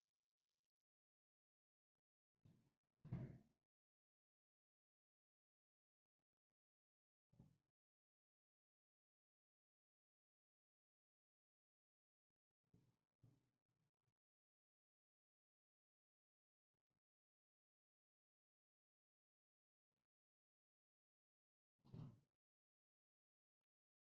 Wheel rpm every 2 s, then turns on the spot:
0, 0, 0, 0, 0, 0, 0, 0, 0, 0, 0, 0.
none